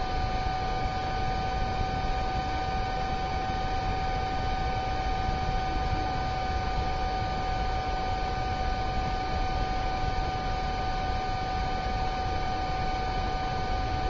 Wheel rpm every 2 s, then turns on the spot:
0, 0, 0, 0, 0, 0, 0.
none